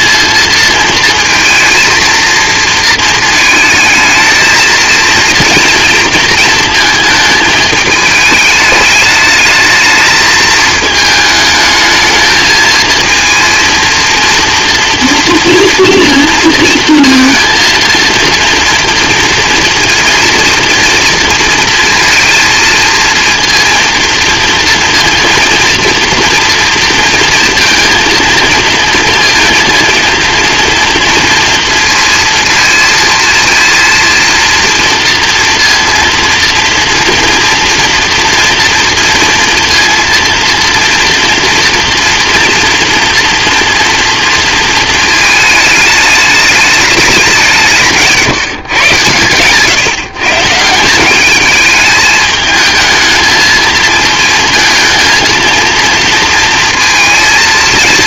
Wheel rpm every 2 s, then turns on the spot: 230, 220, 220, 220, 210, 220, 220, 230, 230, 230, 230, 230, 230, 230, 230, 230, 230, 230, 230, 230, 230, 230, 230, 210, 130, 160, 220, 230, 230.
none